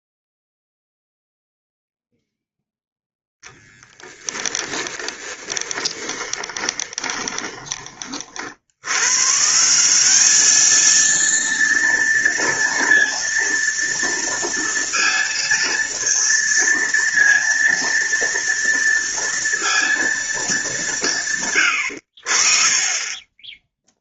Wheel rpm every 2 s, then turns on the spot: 0, 0, 30, 20, 80, 220, 230, 230, 230, 230, 200, 40.
4-8